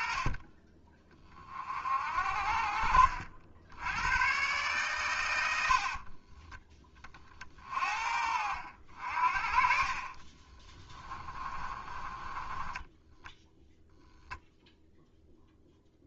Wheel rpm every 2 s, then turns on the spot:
20, 50, 120, 30, 50, 20, 10, 0.
2-4 10-14